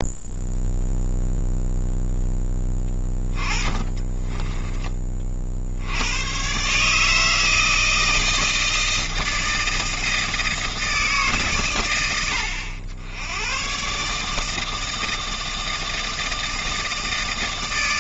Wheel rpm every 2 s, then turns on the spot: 0, 10, 20, 140, 160, 160, 80, 160, 160.
none